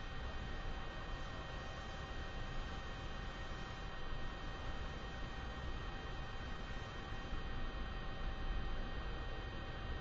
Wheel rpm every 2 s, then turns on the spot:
0, 0, 0, 0, 0.
none